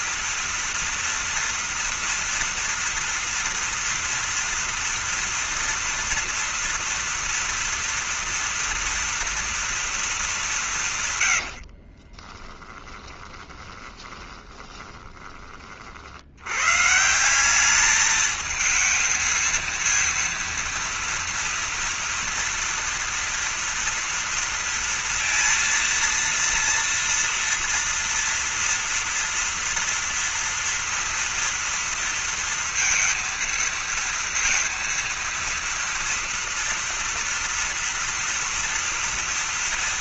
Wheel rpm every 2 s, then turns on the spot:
230, 230, 230, 230, 230, 160, 20, 20, 120, 220, 230, 230, 230, 230, 230, 230, 230, 230, 230, 230.
12-16